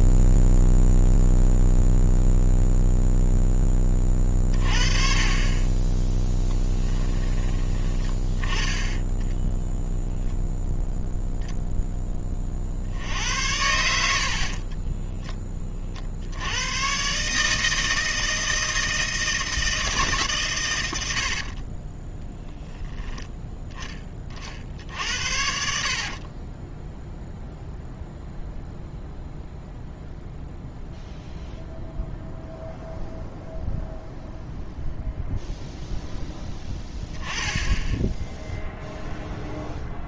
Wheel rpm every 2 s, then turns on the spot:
0, 0, 30, 10, 10, 0, 60, 30, 110, 160, 100, 0, 60, 10, 0, 0, 0, 0, 10, 0.
6-10 14-16